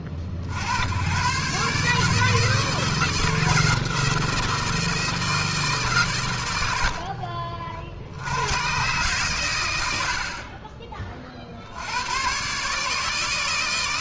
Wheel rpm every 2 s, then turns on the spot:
90, 160, 160, 100, 110, 10, 150.
6-8